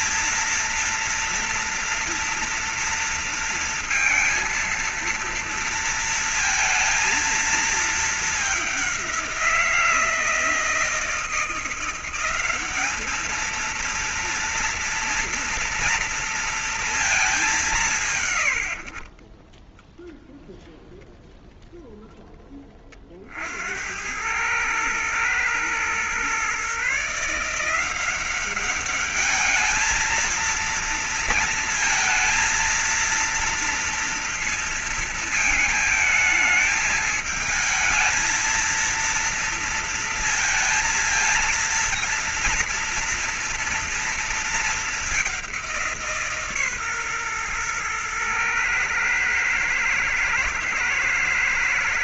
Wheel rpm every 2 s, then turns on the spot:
230, 230, 230, 230, 210, 160, 190, 230, 230, 140, 0, 10, 100, 130, 190, 220, 230, 230, 220, 230, 230, 230, 220, 160, 120, 110.
none